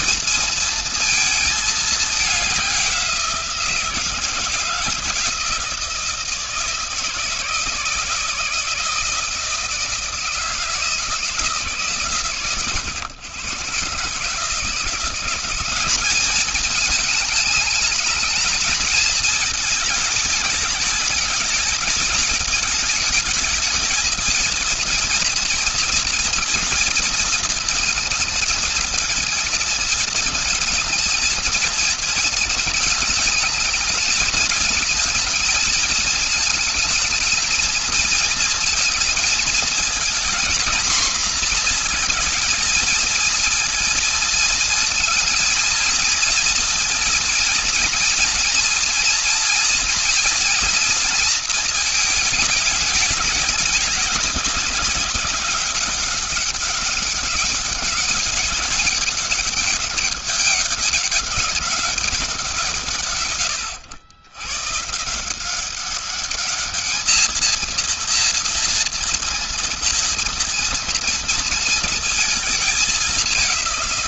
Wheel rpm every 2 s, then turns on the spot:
230, 200, 160, 160, 160, 160, 130, 150, 200, 210, 220, 220, 230, 220, 220, 220, 220, 220, 220, 220, 230, 230, 230, 230, 240, 230, 210, 200, 190, 200, 200, 180, 130, 200, 230, 230, 220.
none